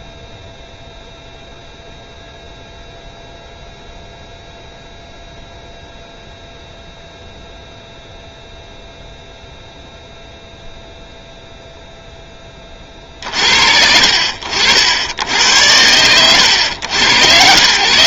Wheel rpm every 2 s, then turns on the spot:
0, 0, 0, 0, 0, 0, 10, 60, 90.
none